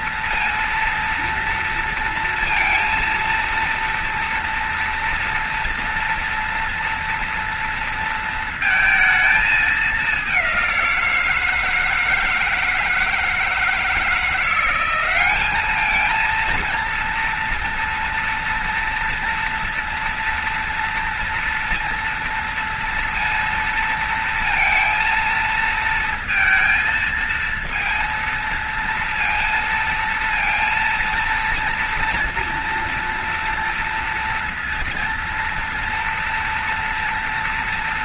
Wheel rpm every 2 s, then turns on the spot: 230, 230, 230, 230, 230, 200, 160, 170, 220, 240, 230, 230, 230, 230, 230, 230, 230, 230, 230.
none